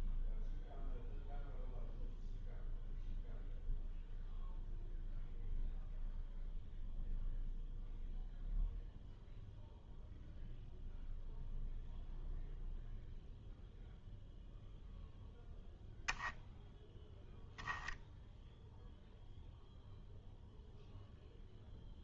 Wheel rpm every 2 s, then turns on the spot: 0, 0, 0, 0, 0, 0, 0, 0, 0, 0, 0.
none